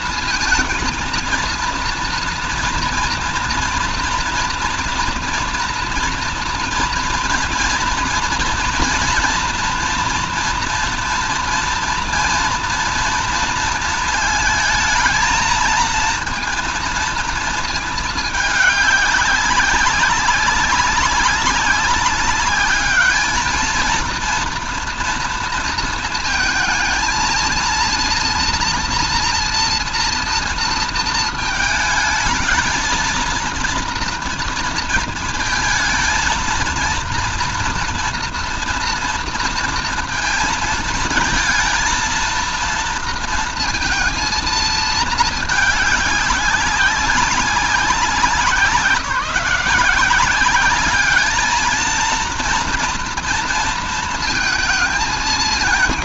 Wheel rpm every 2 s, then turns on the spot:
230, 230, 230, 230, 230, 240, 230, 220, 230, 210, 200, 200, 230, 230, 230, 230, 220, 230, 230, 230, 230, 230, 220, 200, 180, 190, 230, 220.
none